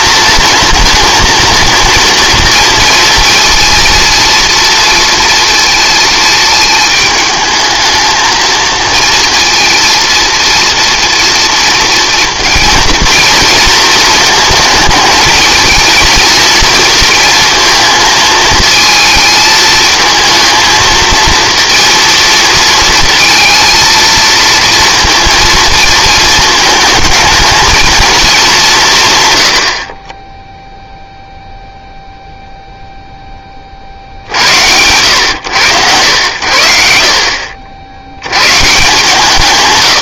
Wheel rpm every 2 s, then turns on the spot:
230, 230, 230, 220, 230, 230, 230, 220, 230, 220, 220, 230, 230, 220, 190, 0, 0, 90, 60, 140.
none